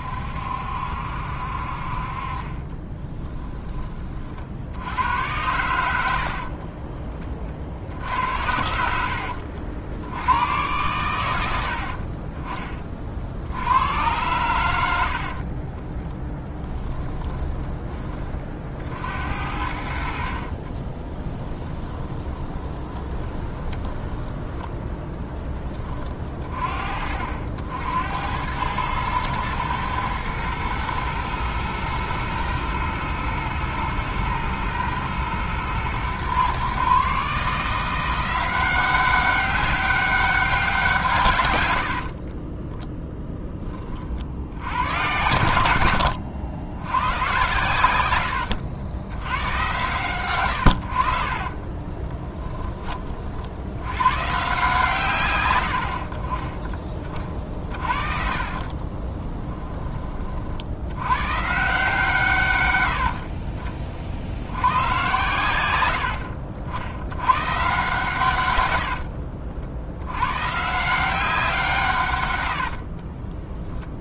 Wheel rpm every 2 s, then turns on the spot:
70, 20, 80, 30, 80, 110, 30, 90, 20, 60, 30, 10, 10, 40, 110, 110, 110, 110, 130, 190, 180, 10, 90, 100, 90, 80, 20, 140, 20, 30, 90, 90, 100, 80, 70, 160, 60.
2-4 6-8 16-18 20-24 42-44 58-60 72-74